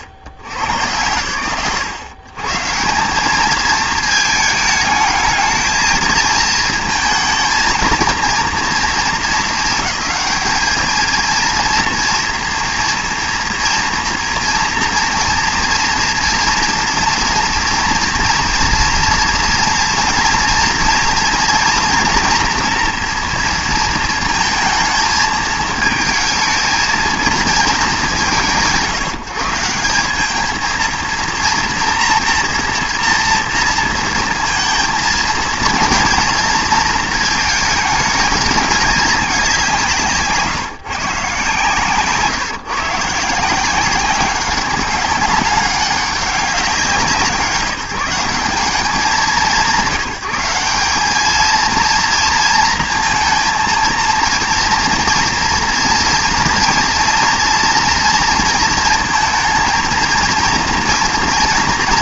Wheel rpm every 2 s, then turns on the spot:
70, 130, 210, 230, 220, 220, 230, 230, 230, 230, 230, 230, 230, 220, 140, 220, 230, 230, 230, 210, 160, 150, 190, 190, 180, 180, 230, 230, 230, 230, 240.
none